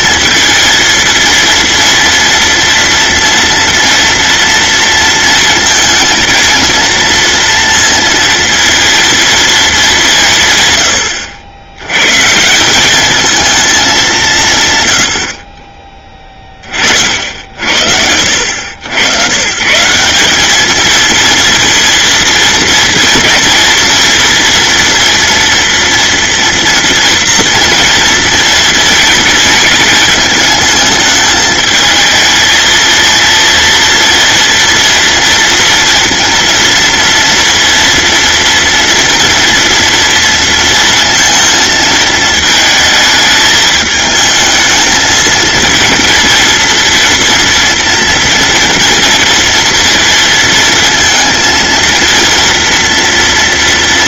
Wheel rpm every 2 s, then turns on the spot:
230, 230, 230, 230, 230, 110, 190, 110, 40, 90, 220, 230, 230, 230, 220, 210, 230, 230, 230, 230, 230, 220, 220, 230, 230, 230, 230.
none